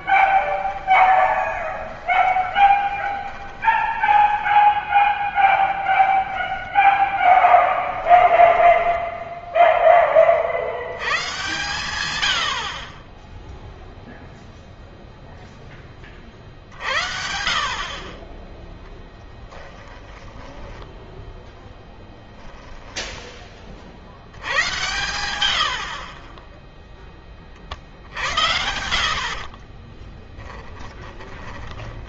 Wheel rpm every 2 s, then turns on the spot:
20, 20, 10, 10, 10, 100, 40, 0, 50, 10, 10, 10, 110, 10, 60, 20.
0-4 8-10 20-26 30-32